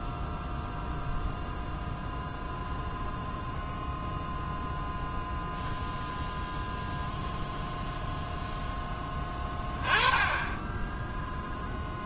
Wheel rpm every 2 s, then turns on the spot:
0, 0, 0, 0, 10, 10.
none